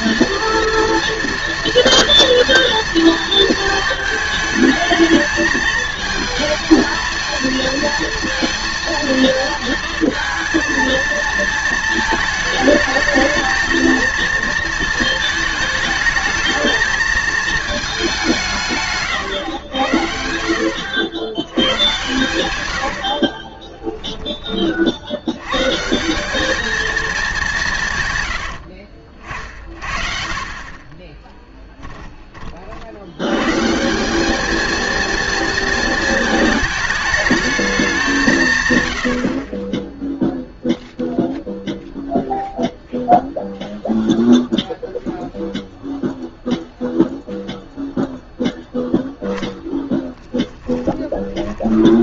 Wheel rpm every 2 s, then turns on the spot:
230, 230, 220, 220, 230, 230, 220, 220, 220, 150, 60, 90, 40, 220, 60, 30, 50, 230, 220, 130, 0, 0, 0, 0, 0, 10.
28-30 50-52